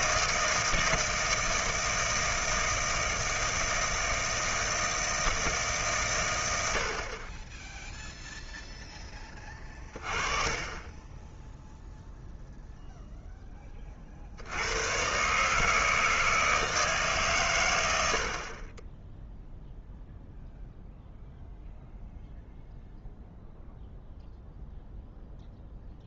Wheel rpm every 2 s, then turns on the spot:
160, 160, 160, 80, 0, 20, 0, 90, 160, 30, 0, 0, 0.
none